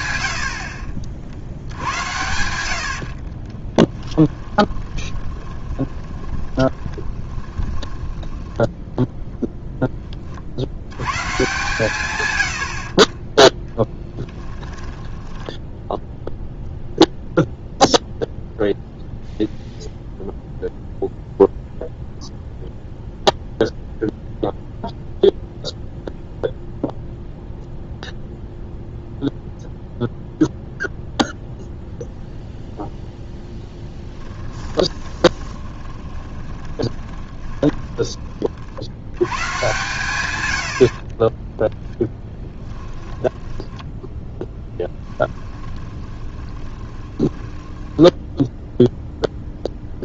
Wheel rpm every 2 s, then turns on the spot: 60, 60, 20, 10, 0, 100, 50, 10, 0, 0, 0, 0, 0, 0, 0, 0, 0, 20, 20, 70, 60, 10, 10, 20, 0.
2-8 14-16 34-38 42-48